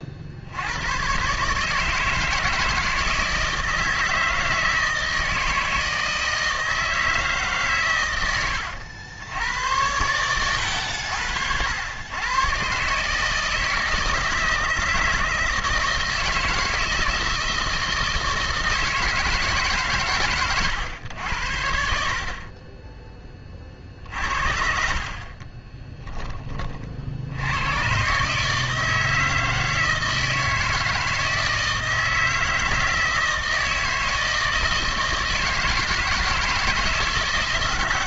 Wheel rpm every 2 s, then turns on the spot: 80, 160, 160, 160, 100, 100, 120, 160, 160, 160, 130, 30, 50, 30, 160, 160, 160, 160, 160.
24-26